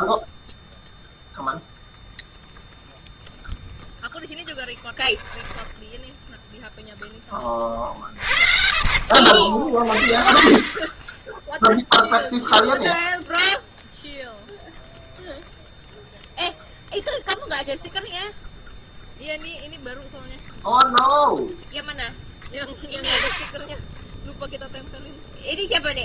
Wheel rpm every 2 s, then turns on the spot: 0, 0, 0, 0, 60, 50, 0, 0, 10, 0, 0, 10, 0.
none